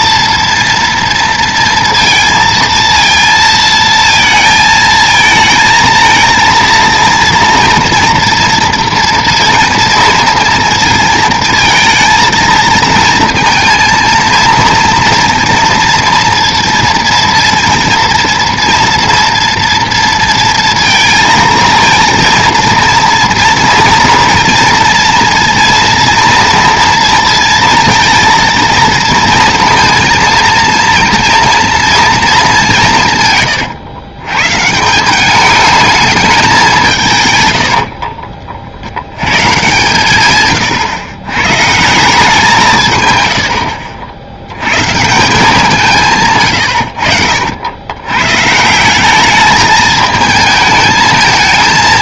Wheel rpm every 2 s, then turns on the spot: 230, 230, 220, 230, 230, 230, 230, 230, 230, 230, 230, 230, 230, 230, 230, 230, 200, 140, 200, 50, 120, 170, 100, 130, 140, 220.
none